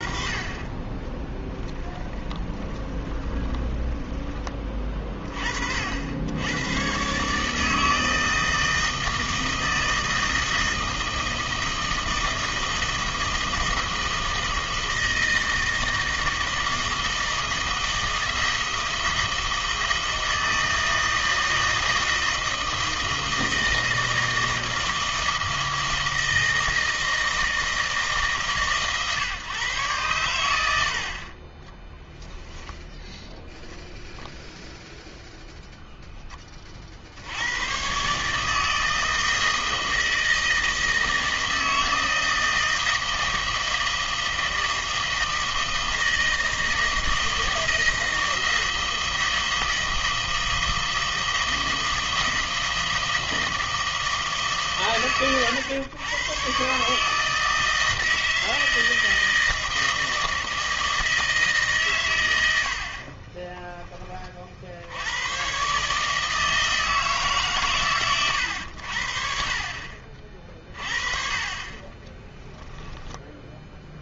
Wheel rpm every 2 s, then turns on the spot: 20, 20, 30, 120, 160, 160, 160, 160, 160, 160, 160, 160, 160, 160, 140, 80, 10, 0, 40, 160, 160, 160, 160, 160, 160, 160, 160, 140, 140, 160, 160, 80, 60, 160, 80, 40, 10.
2-4